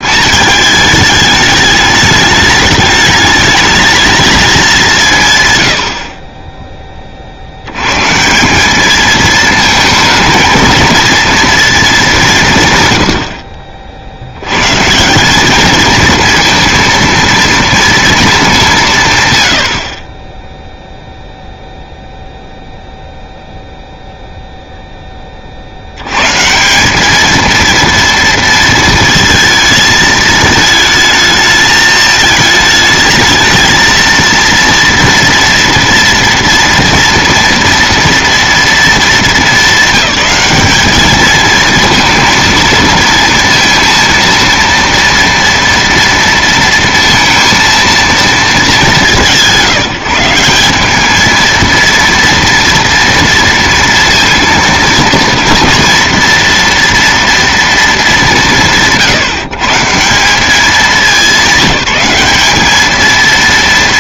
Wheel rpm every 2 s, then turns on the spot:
210, 210, 180, 20, 220, 230, 110, 150, 230, 160, 0, 0, 10, 200, 230, 220, 220, 230, 230, 230, 220, 230, 230, 230, 180, 210, 230, 230, 230, 160, 200, 220.
none